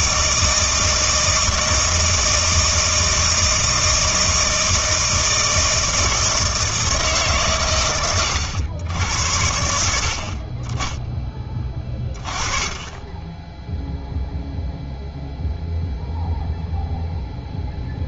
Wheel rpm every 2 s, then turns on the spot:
160, 160, 160, 160, 90, 30, 20, 0, 0.
none